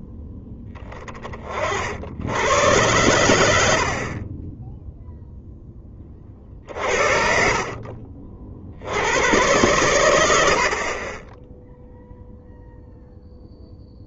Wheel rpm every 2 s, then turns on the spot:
10, 110, 10, 50, 80, 50, 0.
none